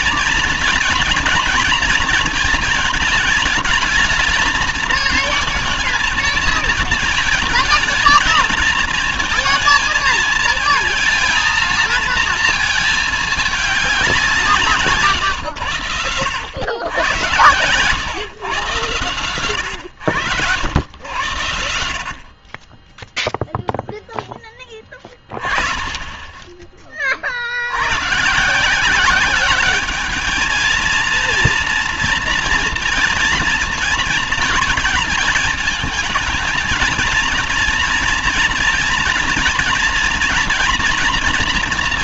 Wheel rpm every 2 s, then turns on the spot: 230, 210, 220, 220, 230, 230, 220, 150, 90, 120, 80, 20, 20, 30, 170, 230, 230, 220, 230, 230, 230.
none